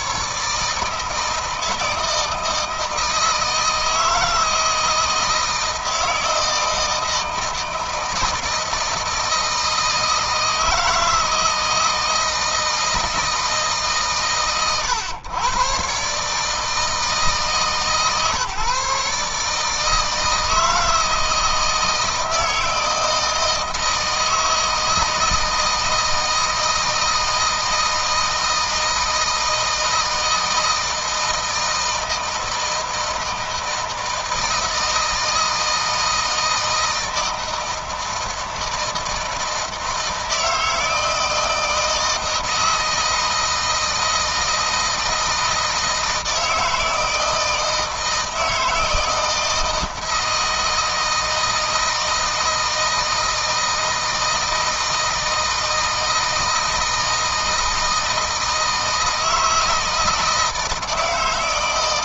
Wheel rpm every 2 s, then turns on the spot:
160, 160, 160, 160, 160, 160, 160, 120, 150, 140, 160, 160, 160, 160, 160, 160, 160, 160, 160, 160, 160, 160, 160, 160, 160, 160, 160, 160, 160, 160, 160.
none